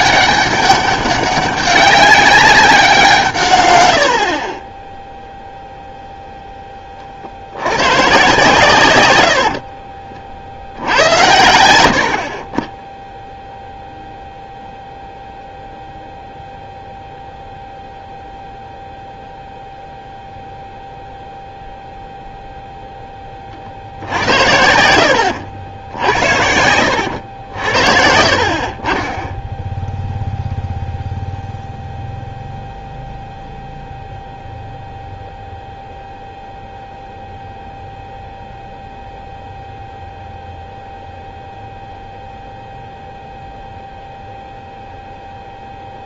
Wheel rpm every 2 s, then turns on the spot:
200, 180, 10, 20, 130, 70, 20, 0, 0, 0, 0, 0, 70, 90, 30, 0, 0, 0, 0, 0, 0, 0, 0.
24-26